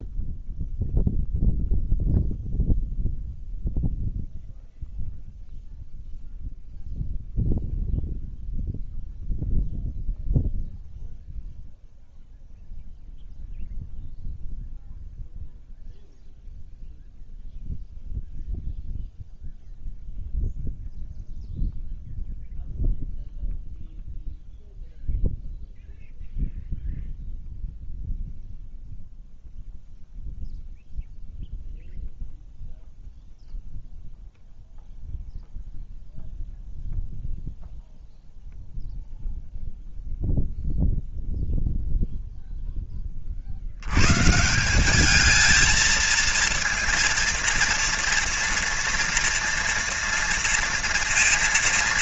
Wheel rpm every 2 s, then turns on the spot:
0, 0, 0, 0, 0, 0, 0, 0, 0, 0, 0, 0, 0, 0, 0, 0, 0, 0, 0, 0, 0, 10, 190, 230, 240, 230.
none